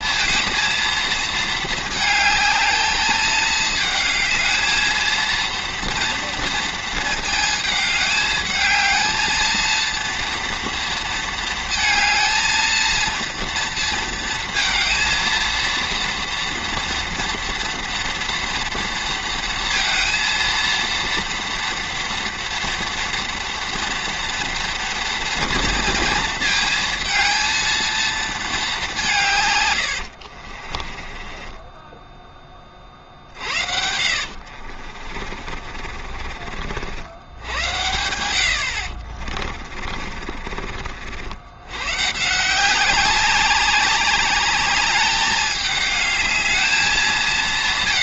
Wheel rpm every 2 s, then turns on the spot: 230, 220, 220, 230, 220, 230, 220, 230, 230, 230, 230, 230, 230, 220, 220, 40, 30, 50, 50, 80, 50, 180, 200, 210.
30-32 34-36